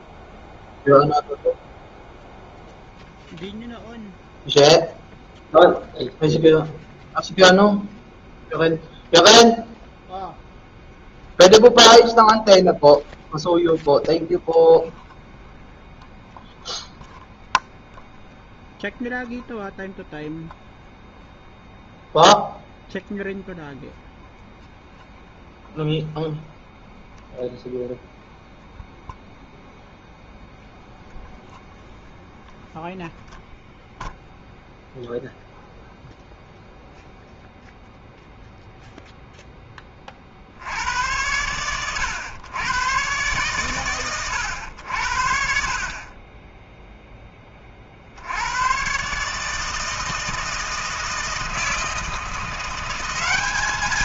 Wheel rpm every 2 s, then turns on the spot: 0, 0, 0, 0, 0, 0, 0, 0, 0, 0, 0, 0, 0, 0, 0, 0, 0, 0, 0, 0, 60, 110, 100, 20, 100, 160, 170.
none